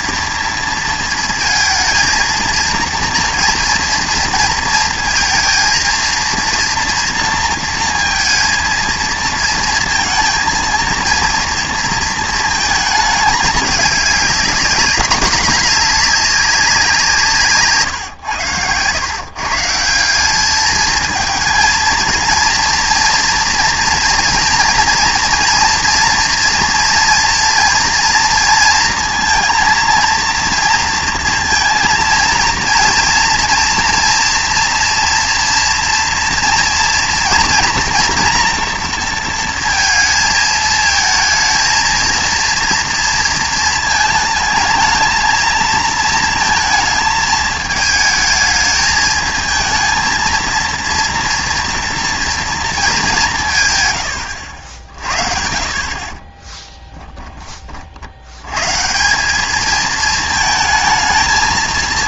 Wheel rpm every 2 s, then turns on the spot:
230, 230, 230, 230, 230, 230, 220, 210, 190, 100, 220, 230, 230, 230, 230, 230, 230, 240, 230, 240, 220, 230, 220, 220, 220, 230, 230, 70, 20, 130, 220.
56-58